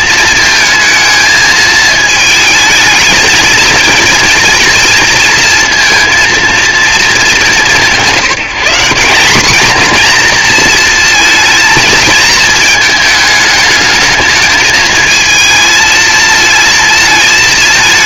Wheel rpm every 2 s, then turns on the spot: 220, 220, 230, 230, 180, 230, 220, 220, 230.
none